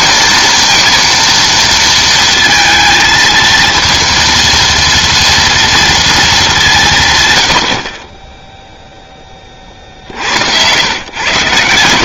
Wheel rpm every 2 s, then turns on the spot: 230, 230, 230, 170, 0, 110.
10-12